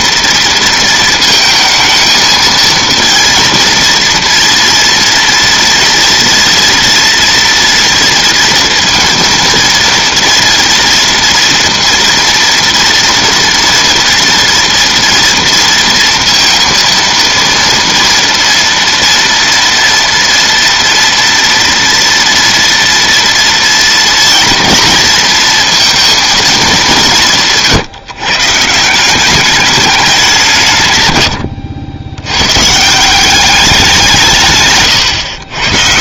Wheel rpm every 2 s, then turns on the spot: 230, 230, 230, 230, 230, 230, 230, 230, 230, 230, 230, 230, 230, 190, 180, 140, 160, 120.
34-36